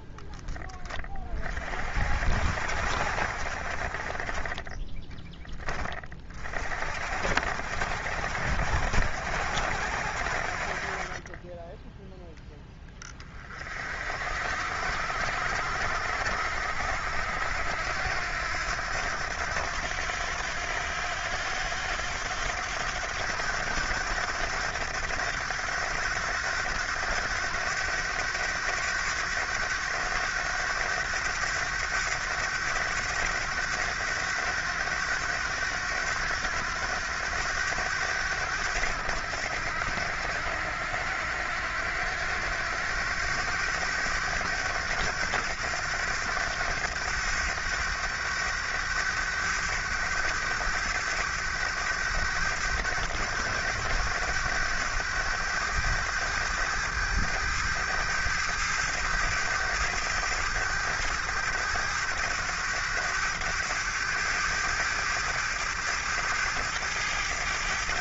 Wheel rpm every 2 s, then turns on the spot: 20, 60, 20, 50, 70, 40, 10, 60, 70, 90, 90, 90, 100, 100, 100, 100, 100, 100, 90, 90, 80, 90, 100, 100, 100, 100, 100, 100, 100, 100, 100, 100, 100, 110.
none